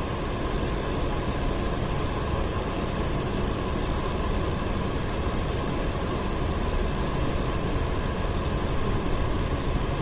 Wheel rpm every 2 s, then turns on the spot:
0, 0, 0, 0, 0.
none